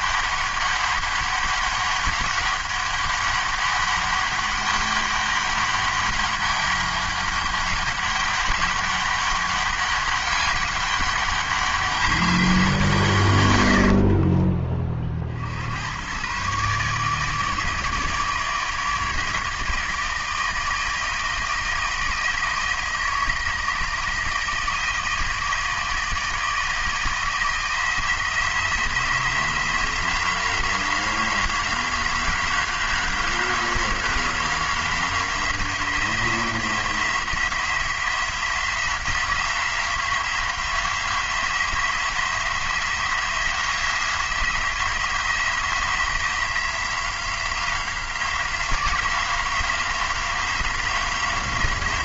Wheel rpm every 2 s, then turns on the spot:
200, 200, 200, 200, 200, 200, 170, 30, 140, 150, 160, 160, 160, 160, 170, 180, 180, 180, 170, 180, 180, 180, 170, 180, 180, 180.
none